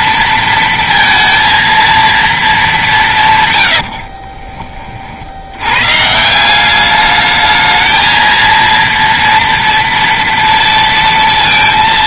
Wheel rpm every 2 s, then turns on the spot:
230, 200, 30, 190, 230, 230.
none